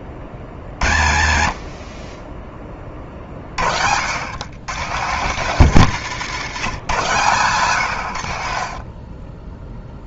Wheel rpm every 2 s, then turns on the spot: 40, 30, 130, 120, 30.
2-4 8-10